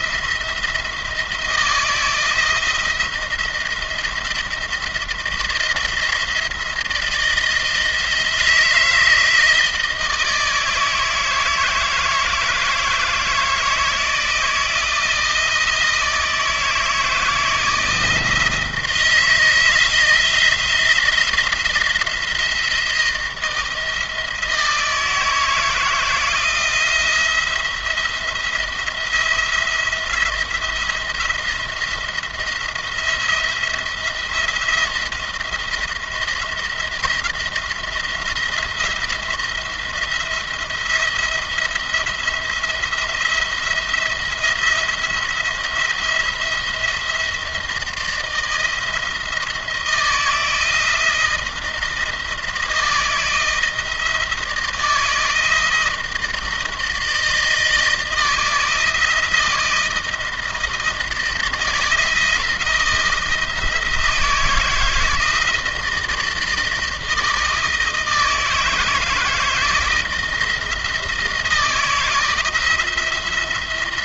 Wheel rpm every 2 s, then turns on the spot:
170, 170, 170, 170, 160, 160, 160, 170, 160, 160, 170, 170, 160, 170, 170, 170, 170, 170, 170, 170, 170, 170, 170, 170, 170, 170, 160, 160, 160, 160, 160, 170, 160, 160, 160, 160, 160.
none